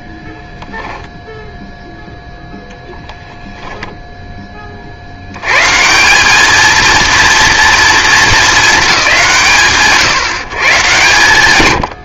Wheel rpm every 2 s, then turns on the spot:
0, 0, 50, 220, 220, 140.
none